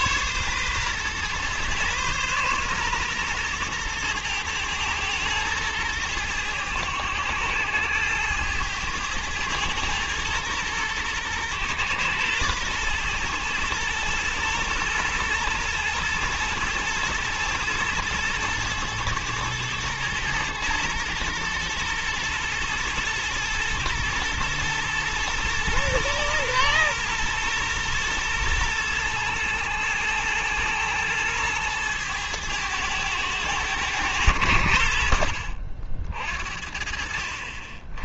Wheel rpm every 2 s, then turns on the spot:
120, 120, 110, 100, 110, 110, 120, 110, 120, 110, 110, 120, 120, 120, 110, 110, 110, 70, 60.
none